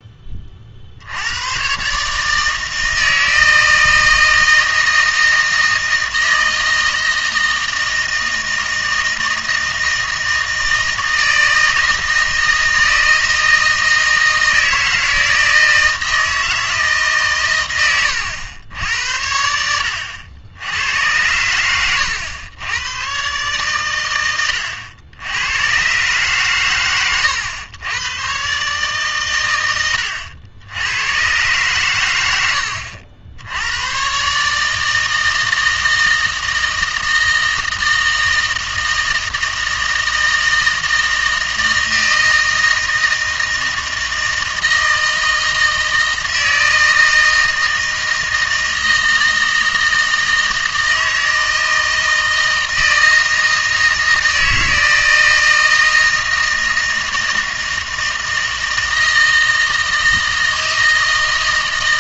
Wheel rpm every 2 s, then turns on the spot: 50, 160, 160, 160, 160, 160, 160, 160, 160, 90, 90, 100, 100, 120, 130, 80, 90, 150, 160, 160, 160, 160, 160, 160, 160, 160, 160, 160, 160, 160, 160.
none